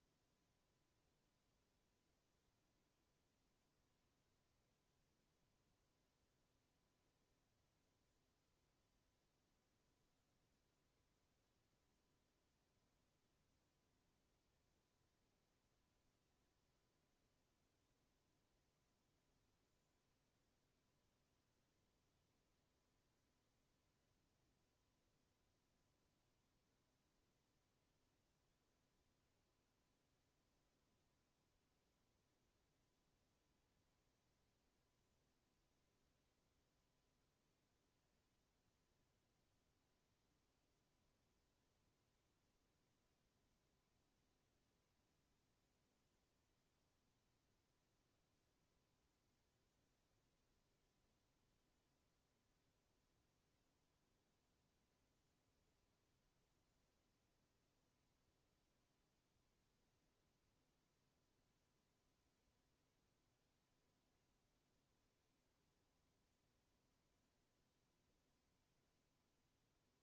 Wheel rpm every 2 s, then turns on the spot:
0, 0, 0, 0, 0, 0, 0, 0, 0, 0, 0, 0, 0, 0, 0, 0, 0, 0, 0, 0, 0, 0, 0, 0, 0, 0, 0, 0, 0, 0, 0, 0, 0, 0, 0.
none